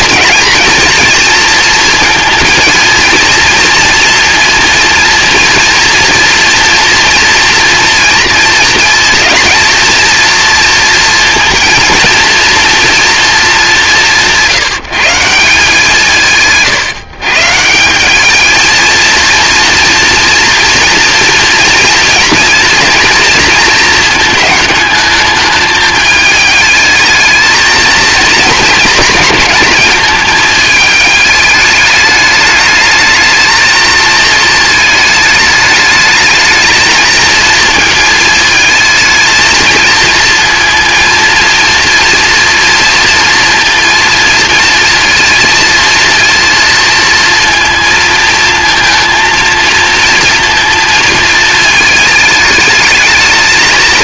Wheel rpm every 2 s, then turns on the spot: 230, 220, 230, 230, 230, 230, 230, 170, 150, 220, 230, 230, 220, 220, 230, 220, 210, 220, 220, 220, 230, 230, 230, 230, 230, 230, 210.
none